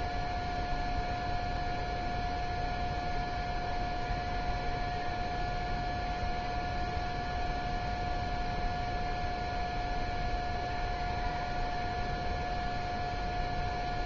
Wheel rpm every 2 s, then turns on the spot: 0, 0, 0, 0, 0, 0, 0.
none